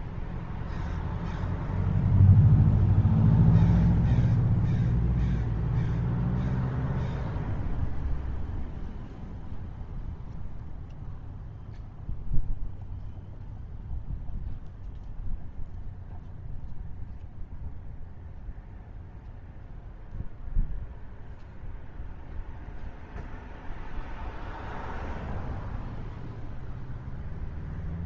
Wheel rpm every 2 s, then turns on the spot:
0, 0, 0, 0, 0, 0, 0, 0, 0, 0, 0, 0, 0, 0.
none